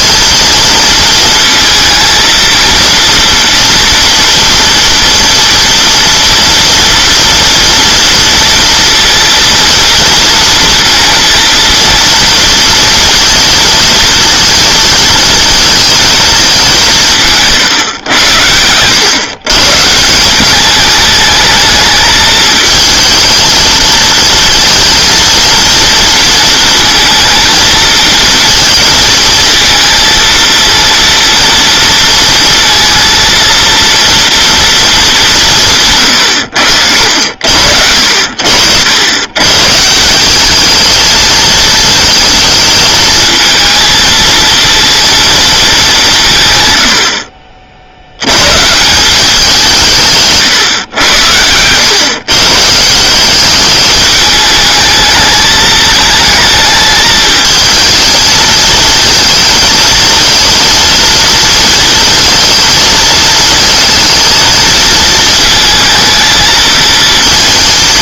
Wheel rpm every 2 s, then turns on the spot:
230, 230, 230, 230, 230, 230, 230, 220, 200, 100, 210, 220, 230, 230, 230, 230, 230, 220, 70, 90, 210, 220, 230, 110, 150, 110, 150, 220, 220, 220, 230, 220, 220, 220.
none